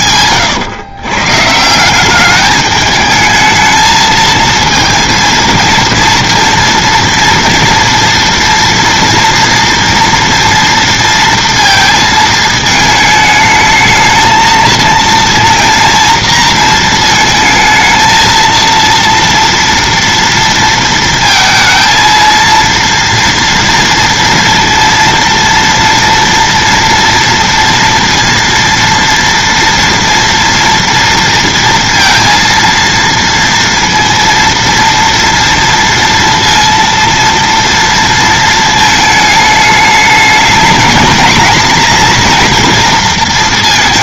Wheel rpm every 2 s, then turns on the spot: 110, 210, 220, 230, 230, 230, 220, 230, 230, 230, 230, 230, 230, 230, 230, 230, 230, 230, 230, 220, 220, 230.
none